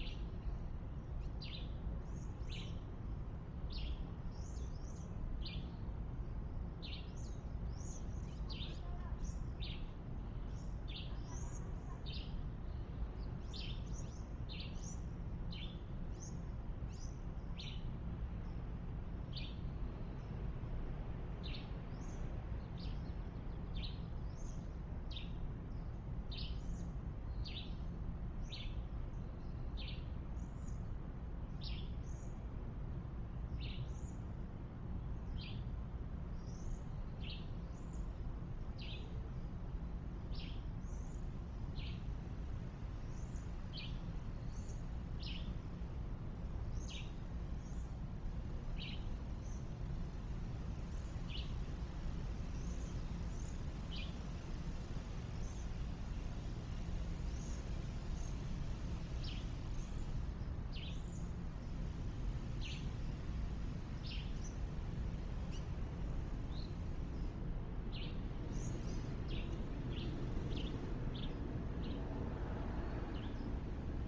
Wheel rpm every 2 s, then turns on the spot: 0, 0, 0, 0, 0, 0, 0, 0, 0, 0, 0, 0, 0, 0, 0, 0, 0, 0, 0, 0, 0, 0, 0, 0, 0, 0, 0, 0, 0, 0, 0, 0, 0, 0, 0, 0, 0.
none